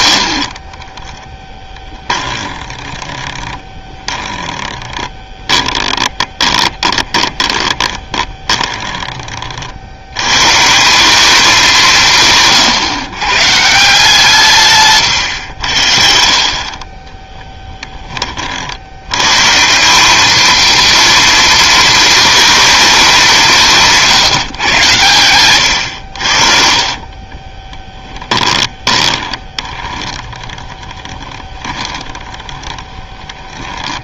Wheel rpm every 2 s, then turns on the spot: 30, 20, 10, 20, 20, 160, 130, 140, 40, 70, 230, 230, 120, 50, 20, 20, 20.
0-10 14-16 26-34